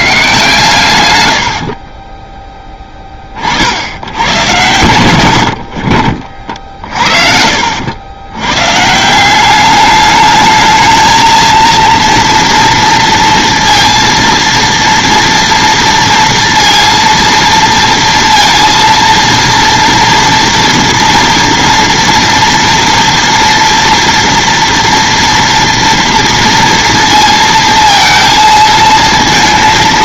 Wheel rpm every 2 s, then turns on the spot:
120, 20, 110, 50, 130, 220, 230, 230, 230, 230, 230, 230, 230, 230, 230.
none